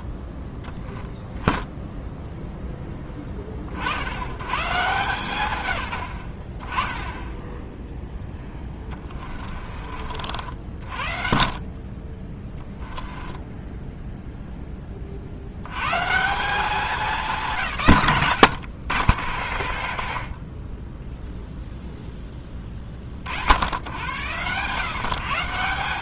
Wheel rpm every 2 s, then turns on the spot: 40, 10, 130, 20, 20, 50, 10, 10, 190, 100, 10, 30, 120.
8-10 12-14 18-22